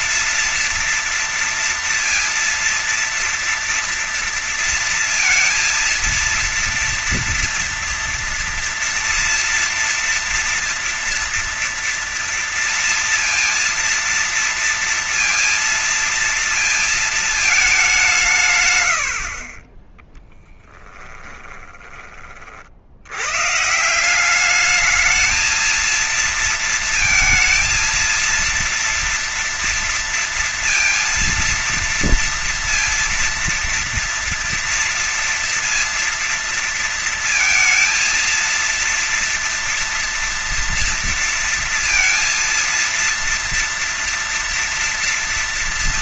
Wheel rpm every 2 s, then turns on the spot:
230, 230, 230, 230, 230, 230, 230, 230, 230, 160, 10, 50, 190, 230, 230, 230, 230, 230, 230, 230, 230, 230, 230.
18-22